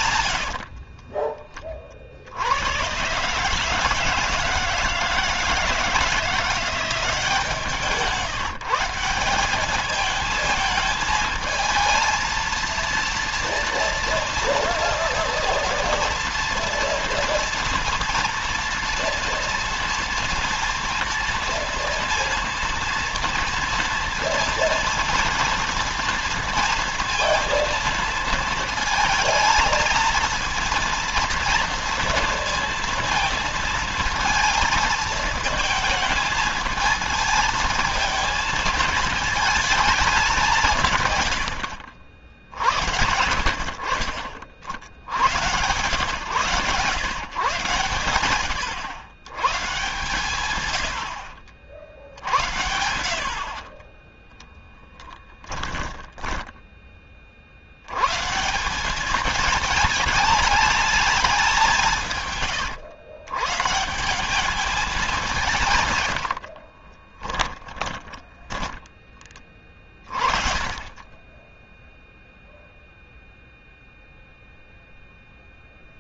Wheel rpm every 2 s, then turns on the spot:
60, 90, 160, 170, 160, 220, 230, 230, 230, 230, 230, 230, 230, 230, 230, 230, 230, 220, 220, 220, 170, 70, 60, 130, 110, 100, 70, 20, 20, 160, 220, 130, 210, 70, 10, 30, 0, 0.
0-2 54-58 66-70